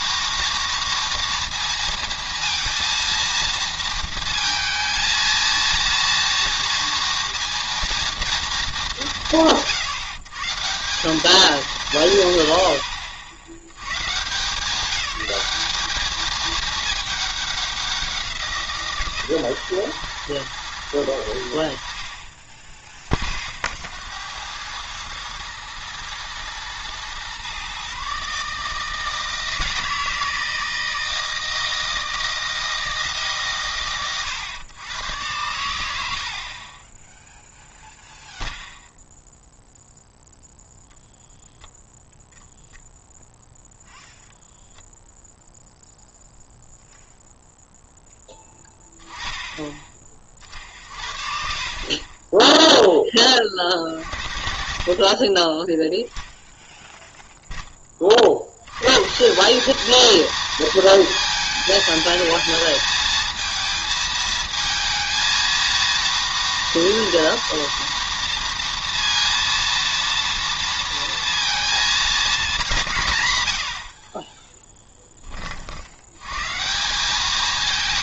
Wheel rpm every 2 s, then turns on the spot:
230, 230, 230, 230, 200, 160, 100, 180, 220, 160, 110, 20, 100, 120, 150, 160, 160, 110, 20, 0, 0, 0, 0, 0, 10, 50, 10, 50, 0, 120, 230, 220, 230, 230, 230, 230, 190, 10, 160.
none